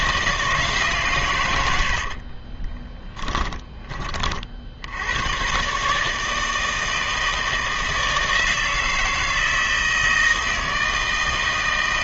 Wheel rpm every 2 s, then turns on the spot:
150, 20, 70, 160, 160, 160.
2-4